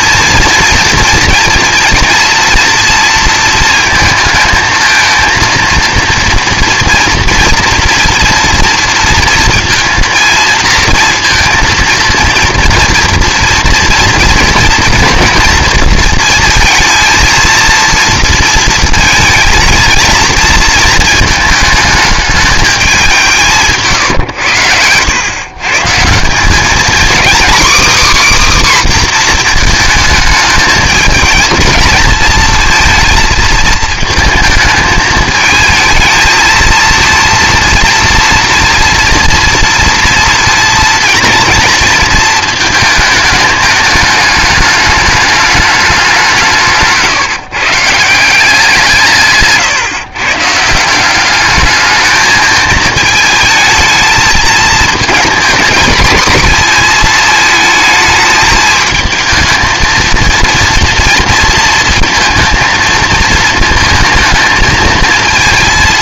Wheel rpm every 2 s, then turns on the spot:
230, 230, 220, 230, 230, 230, 240, 230, 230, 230, 220, 200, 90, 220, 280, 210, 230, 220, 230, 230, 230, 220, 210, 140, 170, 160, 220, 220, 220, 220, 230, 230, 220.
24-26